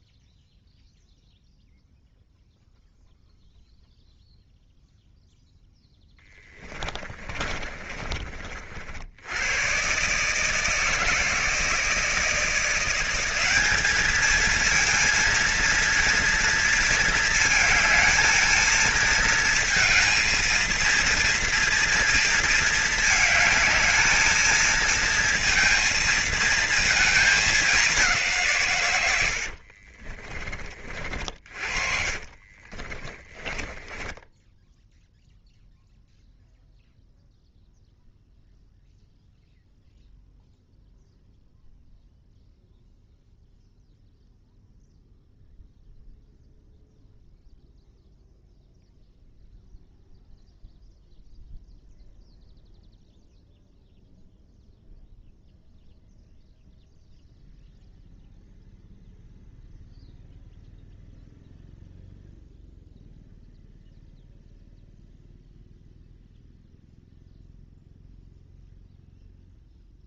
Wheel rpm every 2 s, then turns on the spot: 0, 0, 0, 20, 50, 150, 170, 230, 230, 220, 230, 220, 220, 230, 120, 40, 30, 10, 0, 0, 0, 0, 0, 0, 0, 0, 0, 0, 0, 0, 0, 0, 0, 0, 0.
6-8 32-36